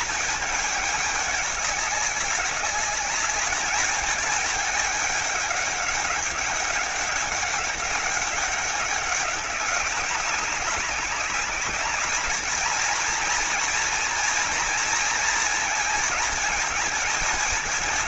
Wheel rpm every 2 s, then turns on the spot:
210, 210, 210, 200, 200, 200, 230, 230, 220.
none